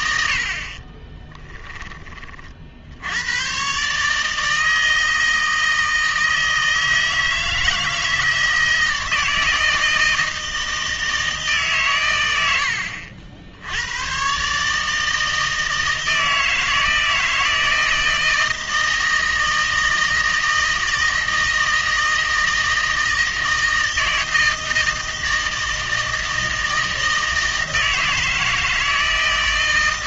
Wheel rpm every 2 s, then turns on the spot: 50, 70, 160, 160, 160, 160, 80, 150, 160, 160, 160, 160, 160, 160, 160.
none